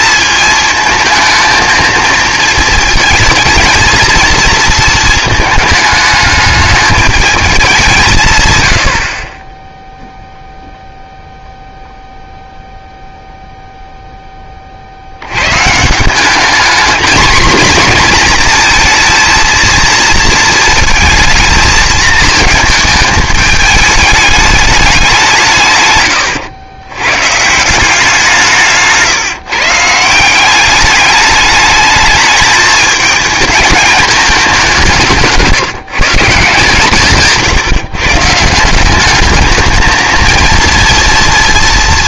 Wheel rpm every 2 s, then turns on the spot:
220, 220, 220, 210, 100, 0, 0, 40, 220, 230, 220, 220, 200, 100, 150, 200, 220, 190, 160, 170, 230.
none